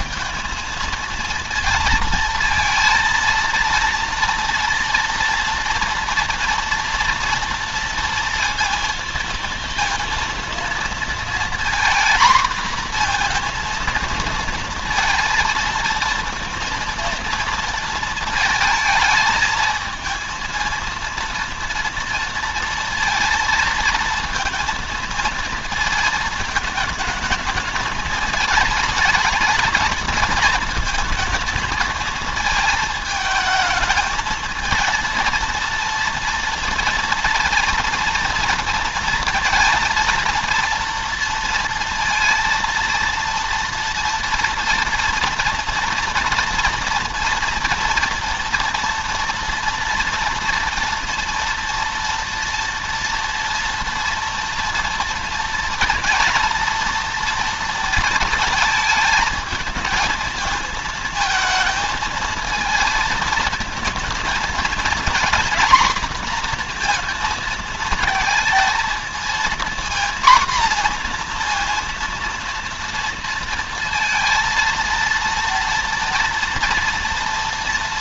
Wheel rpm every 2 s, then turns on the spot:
220, 230, 230, 230, 230, 230, 240, 230, 230, 220, 230, 230, 230, 220, 230, 220, 220, 230, 230, 220, 230, 230, 230, 230, 240, 240, 230, 240, 230, 220, 230, 220, 240, 230, 230, 240, 230, 230, 230.
none